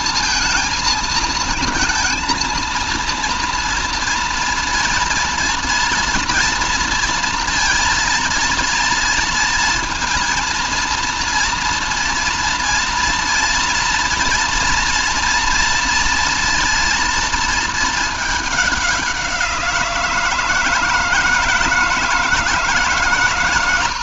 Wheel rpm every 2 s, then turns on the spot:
230, 230, 230, 230, 230, 230, 230, 230, 230, 200, 160, 160.
none